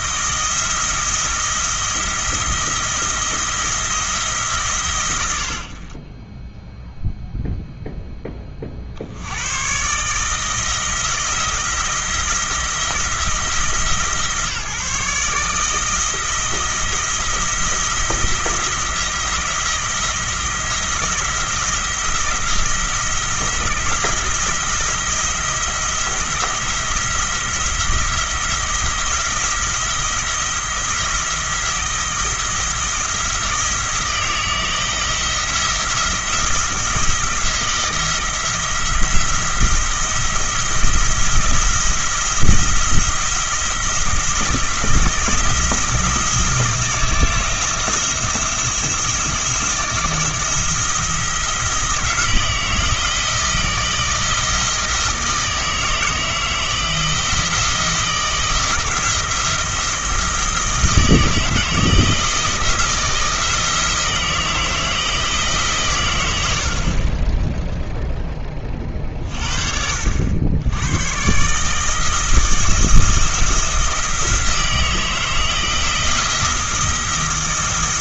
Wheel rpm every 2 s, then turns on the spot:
170, 170, 140, 0, 40, 160, 170, 160, 170, 170, 170, 170, 170, 170, 170, 170, 170, 170, 170, 170, 170, 170, 170, 170, 170, 170, 170, 160, 160, 160, 160, 160, 160, 50, 30, 90, 160, 160, 160.
none